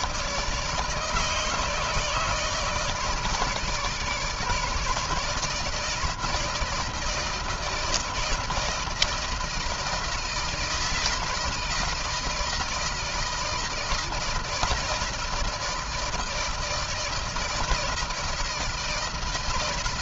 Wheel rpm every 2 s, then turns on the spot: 160, 150, 160, 160, 160, 160, 160, 160, 160, 170.
none